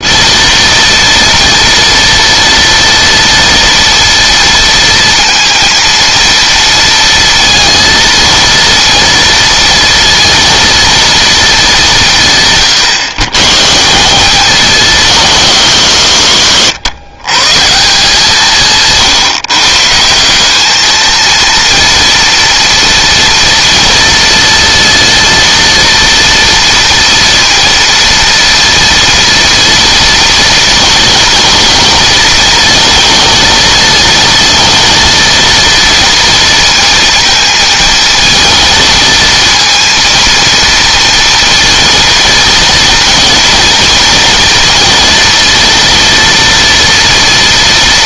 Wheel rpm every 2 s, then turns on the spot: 230, 230, 230, 230, 230, 230, 130, 190, 120, 150, 190, 230, 230, 230, 230, 240, 230, 230, 230, 220, 230, 230, 240, 230.
none